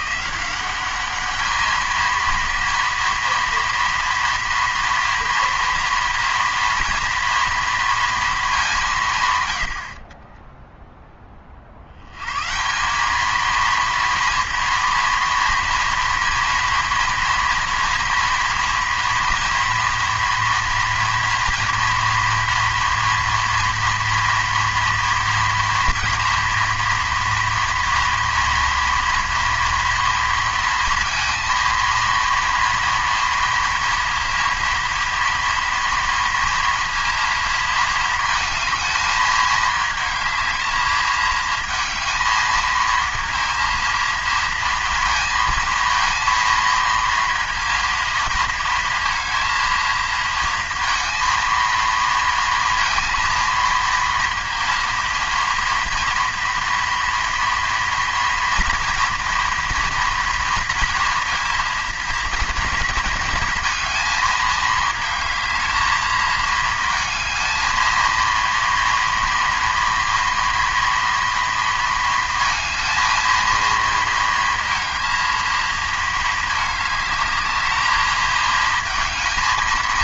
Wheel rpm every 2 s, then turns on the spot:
190, 230, 230, 230, 200, 10, 170, 230, 230, 230, 240, 240, 230, 240, 230, 230, 230, 230, 230, 220, 220, 220, 220, 230, 230, 230, 230, 230, 230, 230, 230, 230, 220, 220, 230, 230, 220, 230, 210, 220.
none